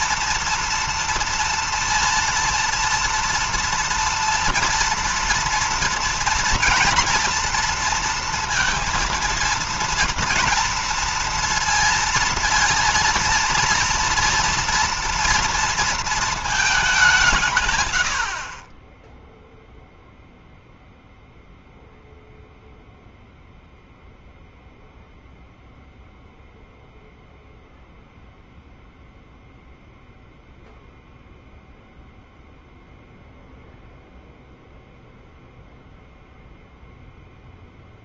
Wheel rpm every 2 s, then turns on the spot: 230, 230, 230, 230, 230, 230, 230, 230, 200, 20, 0, 0, 0, 0, 0, 0, 0, 0, 0.
none